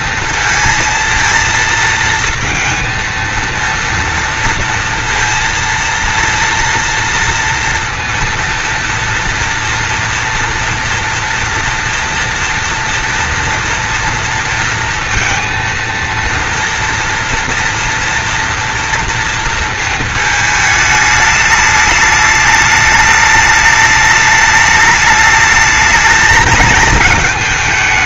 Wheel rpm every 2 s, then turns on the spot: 230, 230, 230, 230, 230, 240, 230, 230, 230, 230, 220, 210, 210, 220.
none